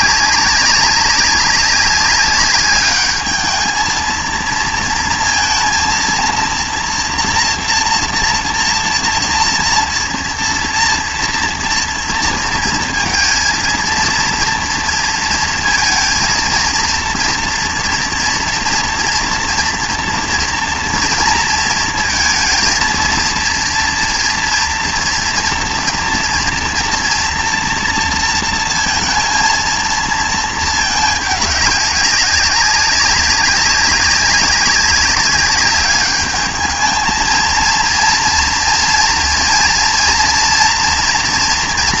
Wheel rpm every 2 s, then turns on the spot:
200, 200, 230, 230, 230, 230, 230, 230, 230, 230, 230, 230, 230, 240, 230, 220, 200, 200, 220, 230, 230.
none